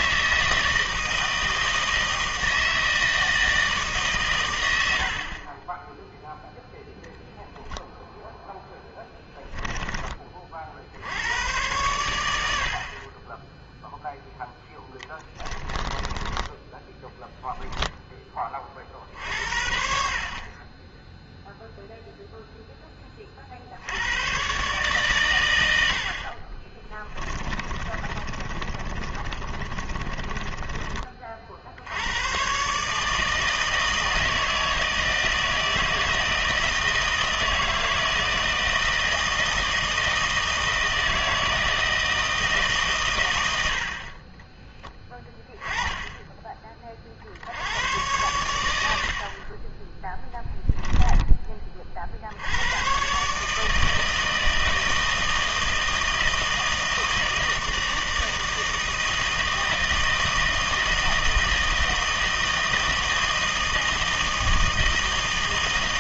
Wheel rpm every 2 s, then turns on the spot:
160, 160, 90, 0, 0, 60, 60, 10, 10, 40, 20, 10, 130, 30, 30, 30, 140, 160, 160, 160, 160, 140, 20, 30, 80, 10, 110, 160, 160, 160, 160, 160, 160.
16-18 26-32 50-52